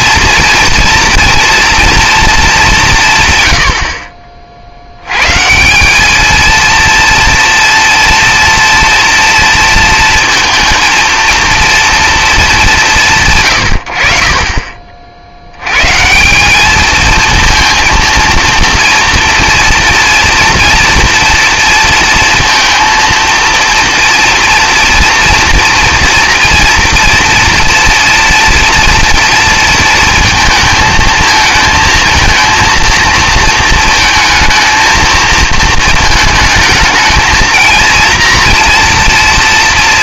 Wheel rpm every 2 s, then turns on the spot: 230, 200, 50, 230, 230, 230, 200, 30, 200, 230, 230, 230, 230, 240, 230, 220, 230, 220, 220, 230.
none